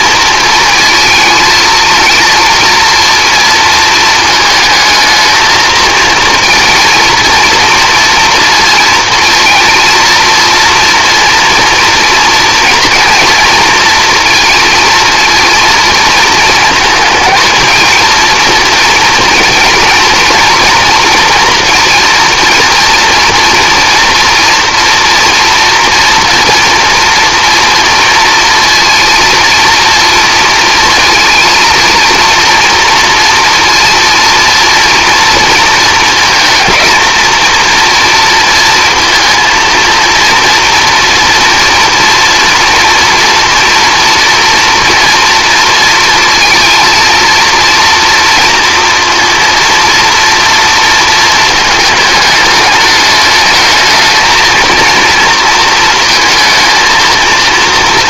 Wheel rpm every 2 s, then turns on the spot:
230, 230, 220, 230, 240, 230, 230, 230, 230, 240, 240, 230, 230, 230, 230, 230, 230, 230, 220, 230, 230, 230, 230, 230, 240, 230, 210, 230, 230.
none